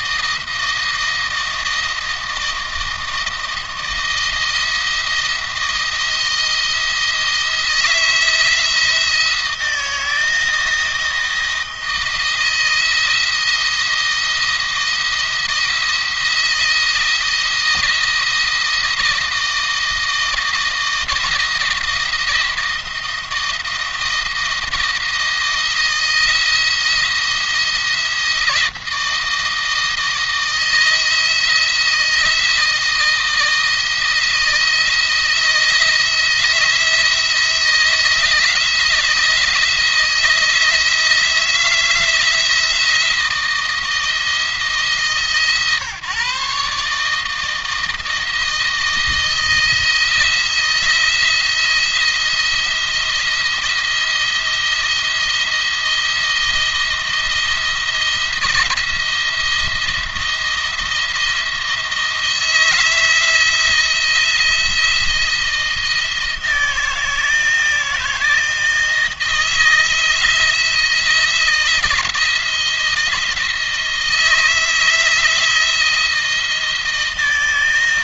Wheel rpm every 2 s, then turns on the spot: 170, 160, 170, 160, 160, 160, 170, 170, 170, 170, 160, 170, 170, 170, 160, 160, 160, 160, 160, 160, 160, 170, 150, 150, 160, 170, 170, 170, 170, 170, 170, 160, 170, 170, 160, 170, 160, 160, 160.
none